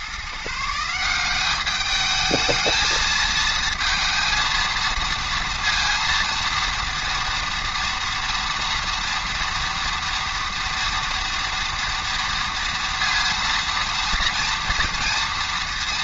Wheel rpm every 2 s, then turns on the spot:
160, 220, 220, 230, 230, 230, 230, 230.
none